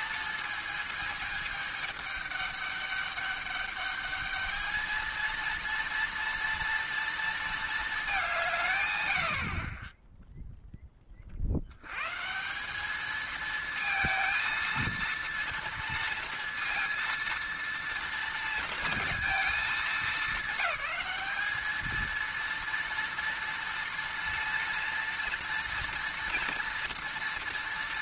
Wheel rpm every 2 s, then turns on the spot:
220, 210, 220, 230, 150, 0, 170, 230, 230, 230, 210, 230, 230, 230.
none